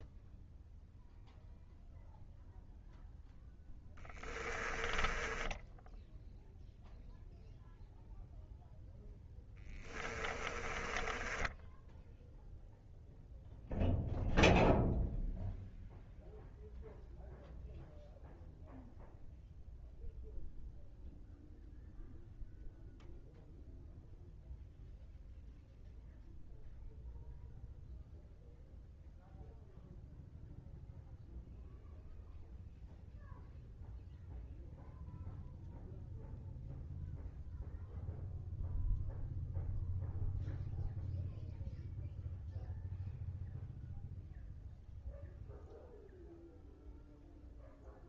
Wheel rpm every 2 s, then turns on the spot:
0, 0, 20, 0, 0, 20, 0, 0, 0, 0, 0, 0, 0, 0, 0, 0, 0, 0, 0, 0, 0, 0, 0, 0.
4-6 10-12